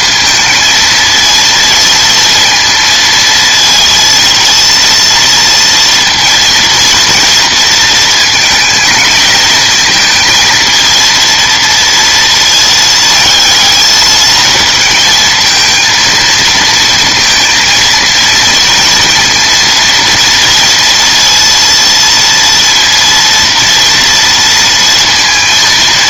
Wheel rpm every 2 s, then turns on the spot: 230, 230, 230, 230, 220, 230, 220, 220, 230, 230, 230, 230, 230.
none